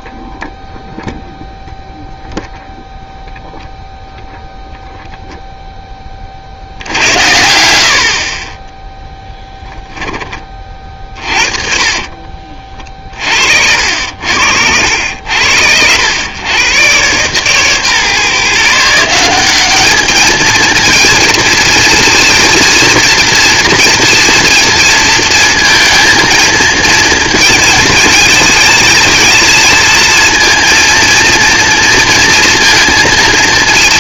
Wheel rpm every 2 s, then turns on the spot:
0, 0, 0, 70, 30, 30, 40, 80, 110, 150, 220, 230, 230, 230, 230, 230, 230.
12-14